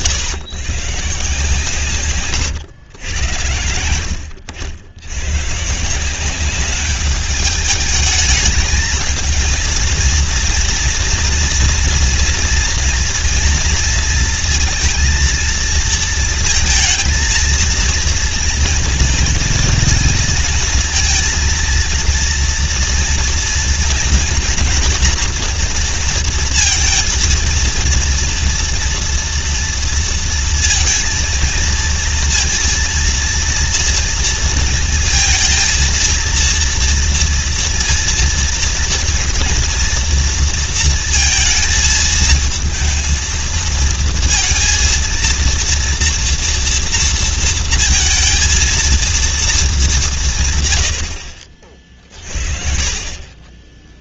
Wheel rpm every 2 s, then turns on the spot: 100, 120, 90, 200, 220, 230, 230, 230, 230, 230, 230, 230, 240, 230, 230, 230, 230, 230, 230, 230, 220, 220, 230, 230, 230, 110, 50.
none